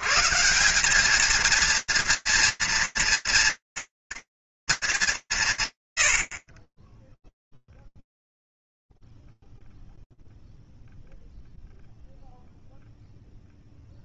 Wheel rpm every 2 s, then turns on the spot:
160, 230, 230, 40, 0, 0, 20.
none